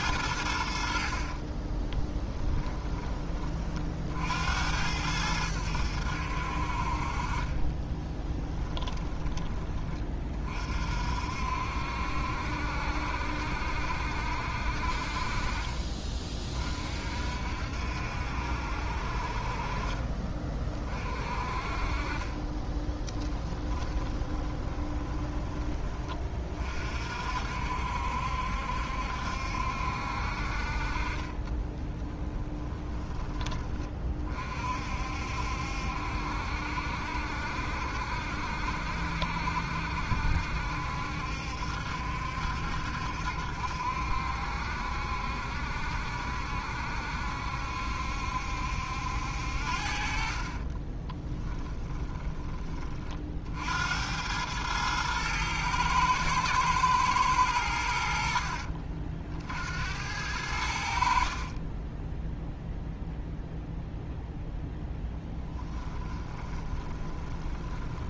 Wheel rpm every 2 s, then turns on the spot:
70, 10, 80, 50, 10, 50, 70, 50, 50, 60, 40, 20, 20, 40, 70, 40, 10, 50, 70, 70, 70, 70, 70, 70, 70, 20, 30, 110, 110, 50, 60, 0, 0, 20.
8-10 22-26 50-52 66-68